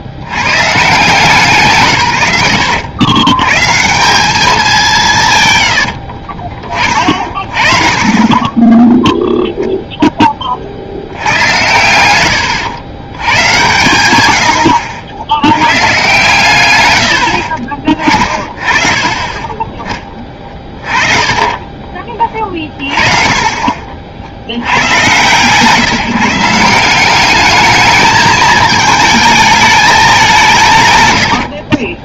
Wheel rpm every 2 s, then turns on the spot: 130, 100, 200, 50, 10, 40, 120, 80, 100, 30, 30, 30, 90, 180, 220, 160.
18-22